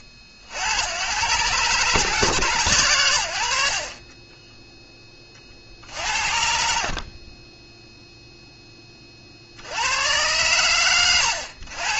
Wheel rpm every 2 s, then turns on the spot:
90, 100, 10, 50, 10, 100.
4-6